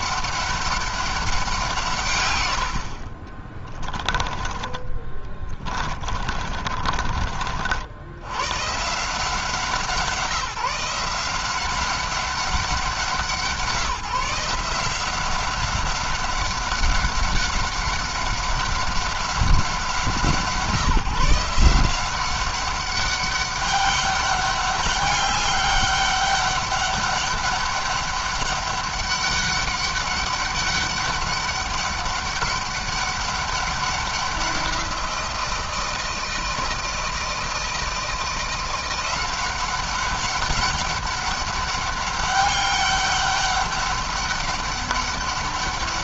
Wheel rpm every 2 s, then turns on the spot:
200, 70, 20, 40, 140, 160, 190, 170, 190, 190, 160, 190, 200, 200, 200, 200, 200, 180, 160, 170, 200, 200, 200.
2-8